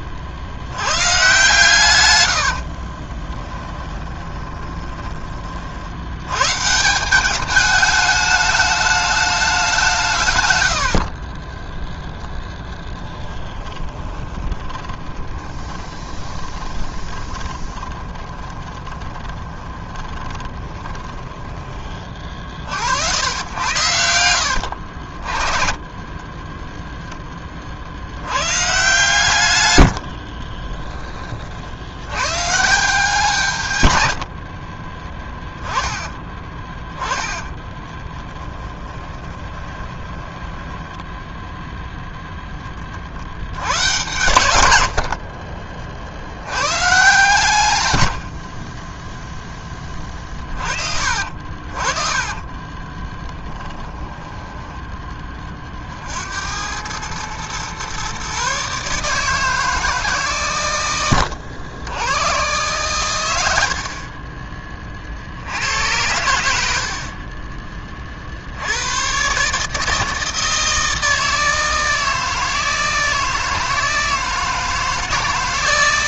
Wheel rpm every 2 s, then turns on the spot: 90, 50, 10, 140, 210, 100, 10, 20, 20, 20, 20, 50, 80, 10, 130, 30, 160, 60, 20, 10, 10, 30, 90, 110, 50, 40, 30, 10, 90, 140, 120, 120, 20, 70, 80, 160, 160, 160.
2-6 10-22 24-26 30-32 34-42 48-50 52-54